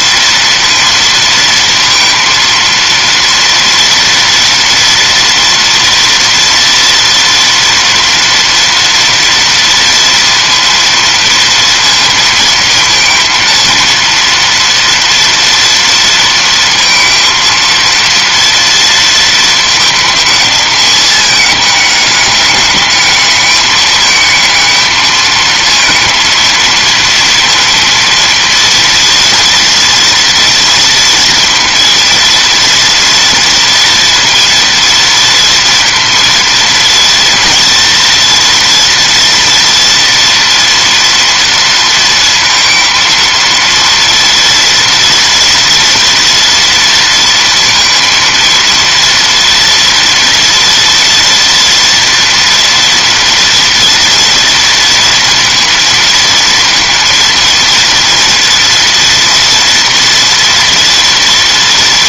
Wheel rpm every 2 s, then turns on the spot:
230, 230, 230, 230, 230, 230, 230, 240, 230, 230, 210, 210, 220, 230, 230, 230, 230, 230, 230, 240, 230, 230, 230, 230, 230, 230, 230, 230, 230, 230, 230.
none